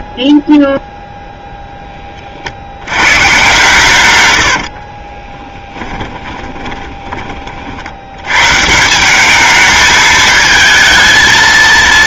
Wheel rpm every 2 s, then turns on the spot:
0, 80, 60, 20, 140, 220.
4-8